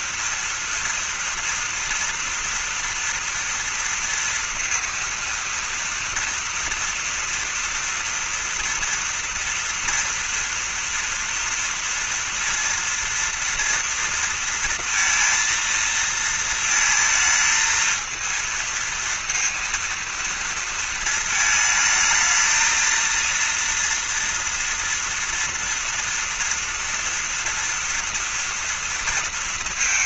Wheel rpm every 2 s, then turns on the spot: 230, 230, 230, 230, 230, 230, 230, 230, 230, 230, 230, 220, 230, 230, 230.
none